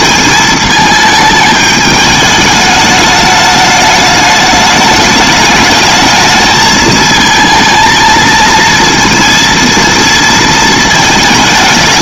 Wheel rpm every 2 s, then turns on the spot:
220, 210, 210, 220, 230, 220.
none